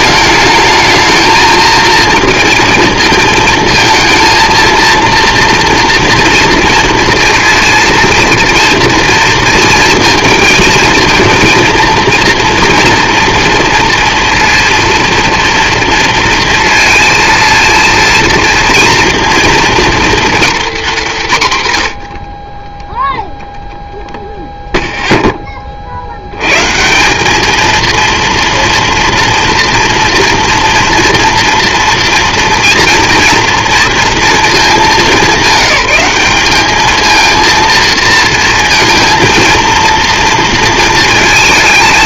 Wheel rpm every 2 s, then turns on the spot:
220, 230, 230, 230, 230, 230, 240, 230, 230, 230, 200, 0, 0, 160, 240, 230, 230, 210, 220, 230, 230.
none